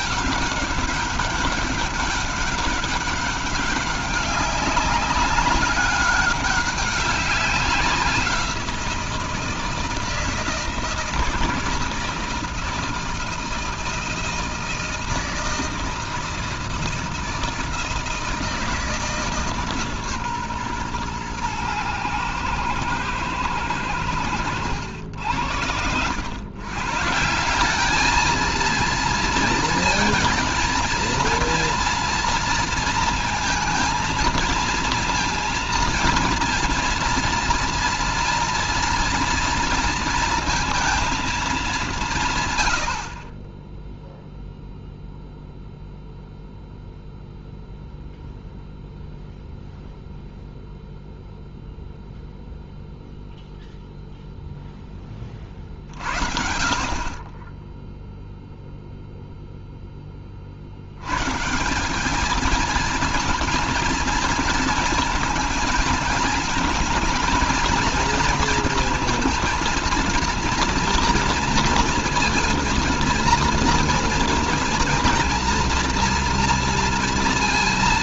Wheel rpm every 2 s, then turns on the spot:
200, 190, 190, 200, 170, 160, 160, 160, 160, 160, 130, 120, 90, 130, 220, 220, 230, 230, 230, 230, 230, 110, 0, 0, 0, 0, 0, 10, 50, 0, 70, 230, 230, 230, 230, 230, 230, 230, 230.
none